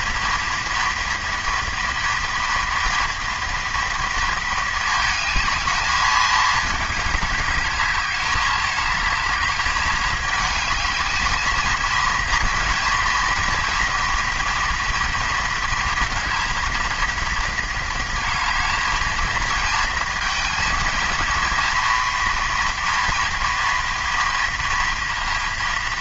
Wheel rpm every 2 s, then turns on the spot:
230, 230, 220, 210, 210, 220, 240, 230, 230, 230, 230, 230, 230.
none